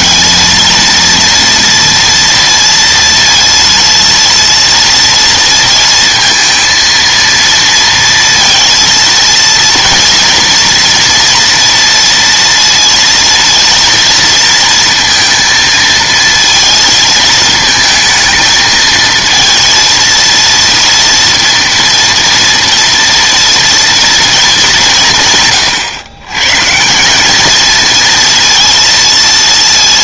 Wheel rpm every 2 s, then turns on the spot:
230, 230, 230, 230, 230, 230, 230, 230, 230, 220, 230, 240, 190, 150, 230.
none